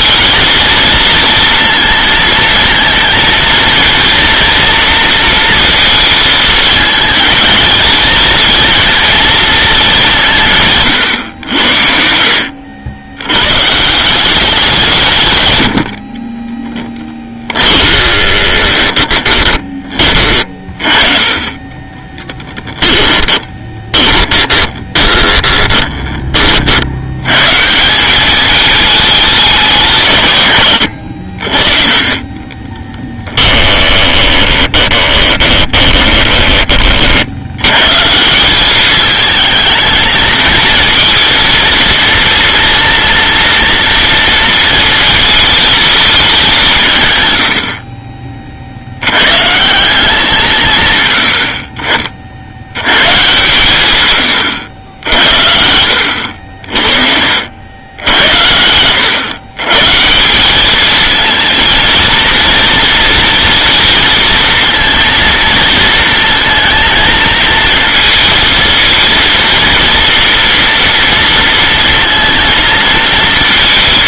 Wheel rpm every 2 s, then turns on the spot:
230, 230, 230, 220, 230, 150, 80, 180, 20, 20, 30, 10, 20, 50, 210, 100, 20, 20, 30, 200, 230, 230, 230, 170, 60, 140, 100, 80, 60, 90, 210, 230, 230, 230, 230, 230, 230.
16-20 22-26 32-36 56-58